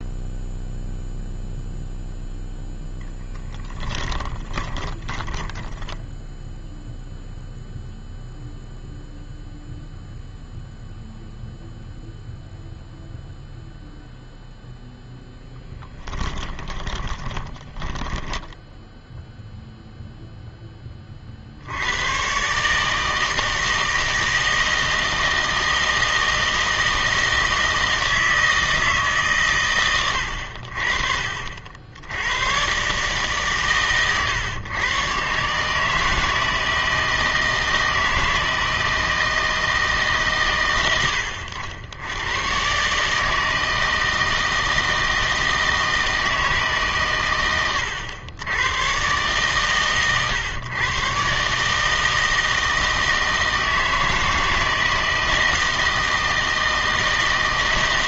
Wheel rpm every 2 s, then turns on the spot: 0, 10, 30, 0, 0, 0, 0, 0, 20, 0, 10, 140, 160, 160, 160, 70, 120, 120, 160, 160, 120, 140, 160, 150, 110, 120, 160, 160, 160.
2-6 16-18